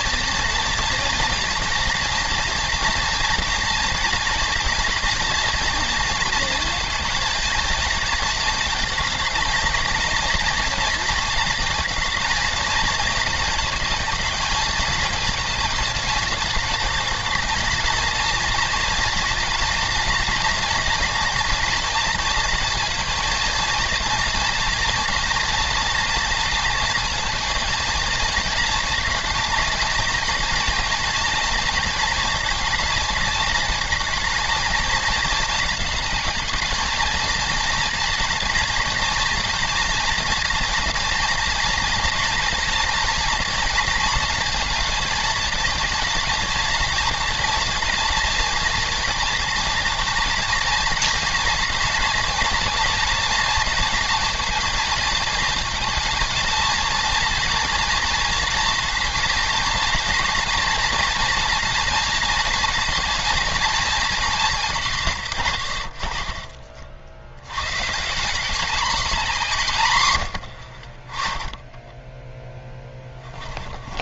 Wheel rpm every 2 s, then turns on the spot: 230, 230, 230, 230, 220, 230, 220, 220, 220, 240, 230, 230, 230, 230, 230, 230, 230, 220, 220, 230, 240, 230, 230, 220, 230, 230, 230, 230, 230, 230, 230, 230, 190, 40, 210, 70, 10.
72-74